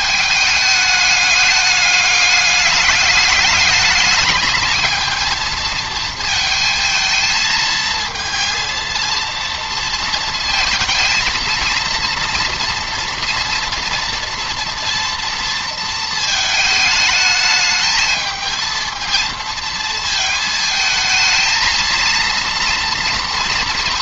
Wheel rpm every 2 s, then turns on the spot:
210, 210, 220, 220, 230, 230, 230, 230, 220, 220, 220, 230.
none